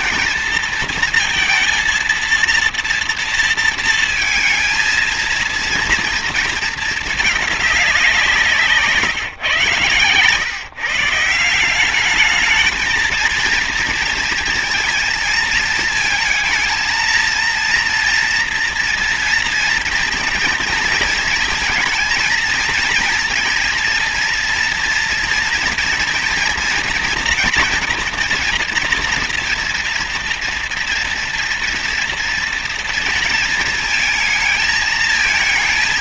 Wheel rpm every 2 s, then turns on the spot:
230, 230, 230, 230, 180, 130, 210, 230, 220, 230, 230, 230, 230, 230, 230, 230, 230, 220.
none